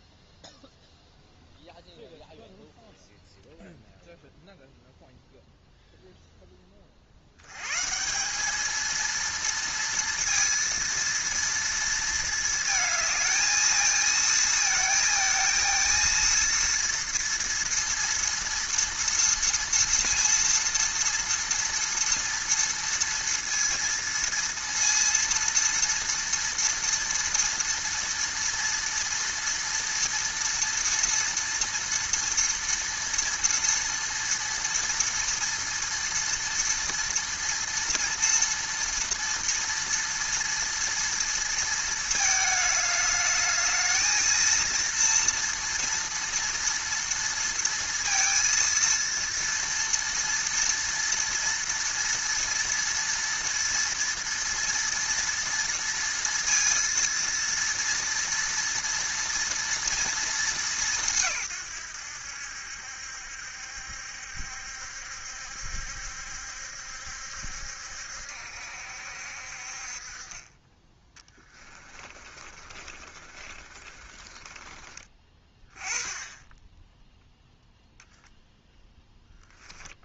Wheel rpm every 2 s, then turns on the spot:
0, 0, 0, 20, 220, 230, 220, 220, 230, 230, 230, 230, 230, 230, 230, 230, 230, 230, 230, 230, 230, 210, 230, 230, 230, 230, 230, 230, 230, 230, 200, 70, 70, 70, 70, 20, 40, 30, 10, 0.
72-76